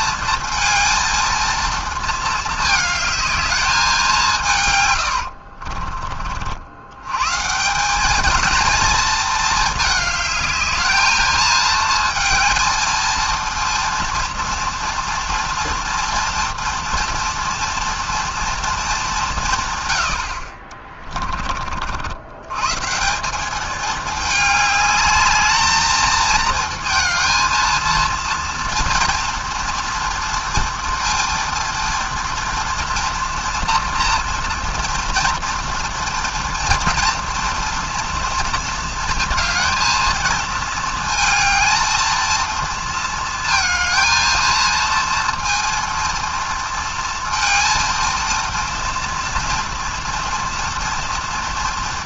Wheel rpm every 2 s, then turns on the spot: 230, 220, 120, 80, 230, 220, 230, 230, 240, 220, 40, 150, 210, 230, 230, 240, 230, 230, 230, 230, 220, 230, 230, 230, 230, 230.
20-22